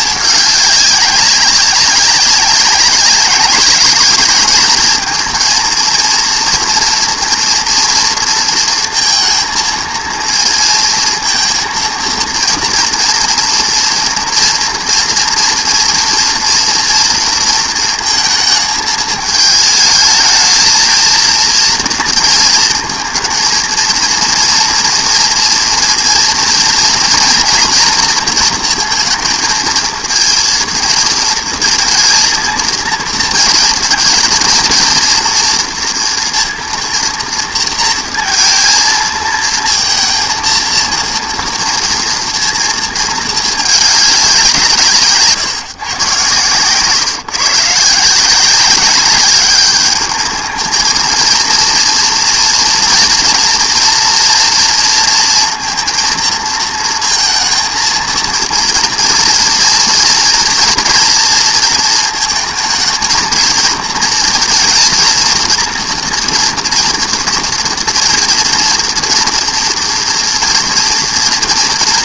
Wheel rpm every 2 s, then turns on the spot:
200, 190, 220, 230, 230, 230, 230, 230, 230, 220, 220, 220, 230, 230, 230, 230, 230, 230, 230, 230, 230, 230, 180, 140, 190, 220, 230, 230, 230, 230, 240, 220, 230, 230, 230, 230.
46-48